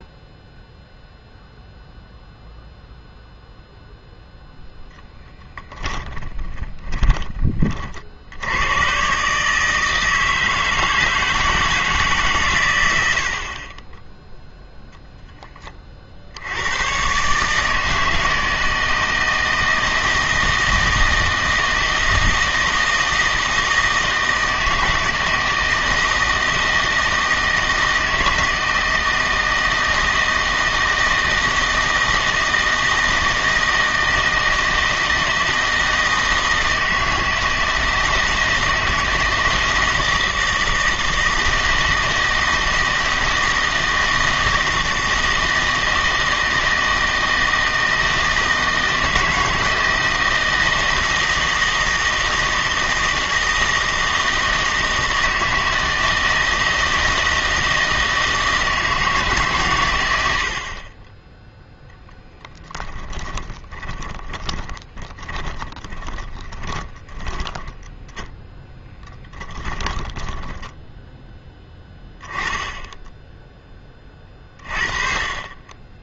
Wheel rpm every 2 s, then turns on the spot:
0, 0, 0, 20, 110, 160, 120, 0, 110, 160, 160, 160, 160, 160, 160, 160, 160, 160, 160, 160, 160, 160, 160, 160, 160, 160, 160, 160, 160, 160, 50, 20, 20, 20, 10, 10, 10, 30.
6-8 62-72